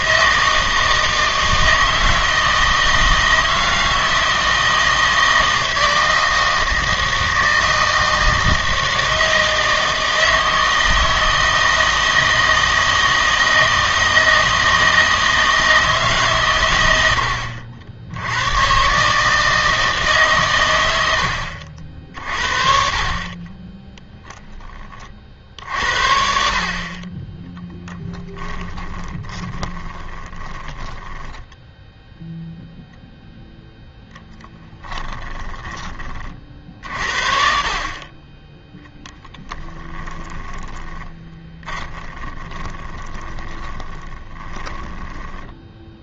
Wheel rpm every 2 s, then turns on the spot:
160, 160, 160, 160, 160, 160, 160, 160, 110, 120, 120, 40, 10, 50, 20, 10, 0, 10, 50, 10, 20, 20, 10.
28-32 34-36 40-46